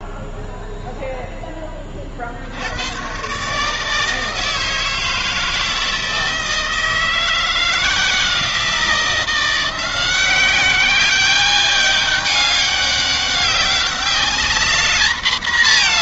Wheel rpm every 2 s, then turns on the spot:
0, 70, 150, 160, 160, 190, 200, 210.
none